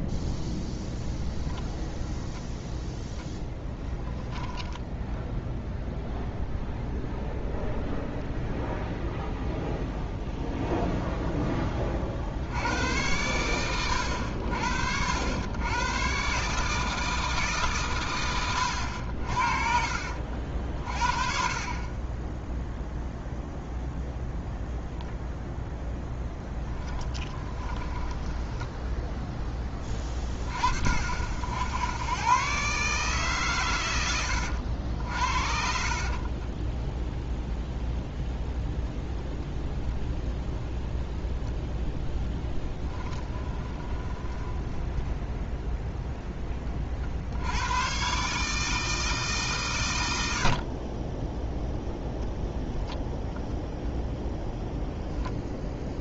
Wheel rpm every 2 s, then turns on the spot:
0, 0, 10, 0, 0, 0, 90, 60, 150, 100, 60, 0, 0, 10, 10, 40, 140, 70, 10, 0, 0, 10, 10, 30, 150, 40, 0, 0.
26-30 36-38 44-46